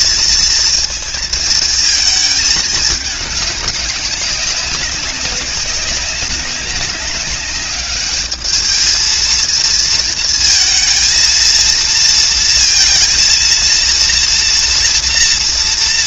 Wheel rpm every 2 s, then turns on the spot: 230, 210, 200, 200, 220, 230, 230, 230.
none